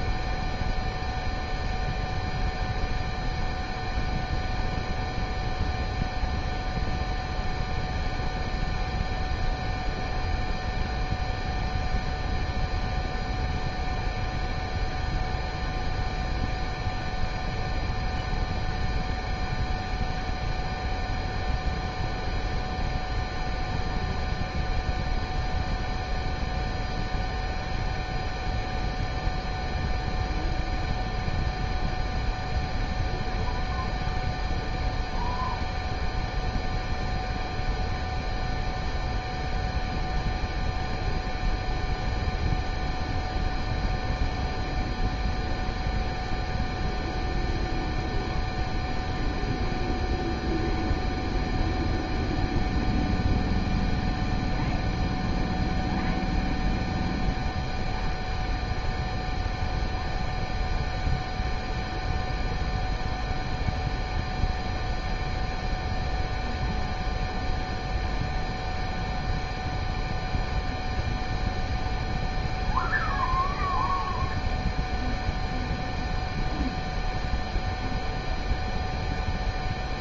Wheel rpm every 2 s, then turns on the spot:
0, 0, 0, 0, 0, 0, 0, 0, 0, 0, 0, 0, 0, 0, 0, 0, 0, 0, 0, 0, 0, 0, 0, 0, 0, 0, 0, 0, 0, 0, 0, 0, 0, 0, 0, 0, 0, 0, 0, 0.
none